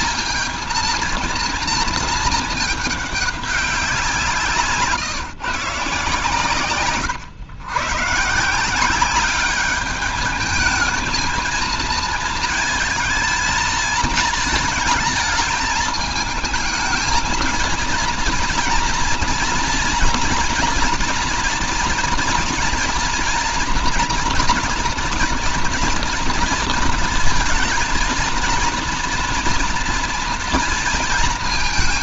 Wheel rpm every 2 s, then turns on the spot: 230, 220, 160, 140, 160, 210, 220, 220, 220, 230, 230, 230, 240, 230, 230, 230.
none